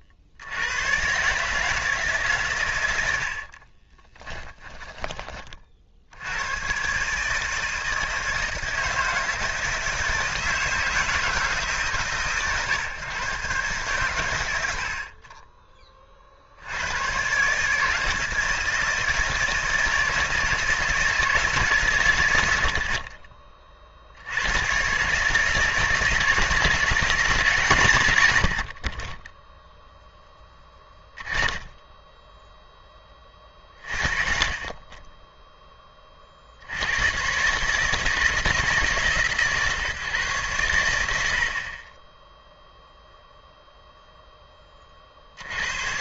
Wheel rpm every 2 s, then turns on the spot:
100, 100, 10, 130, 160, 160, 130, 70, 70, 160, 160, 70, 130, 170, 40, 10, 10, 20, 80, 140, 100, 0, 30.
none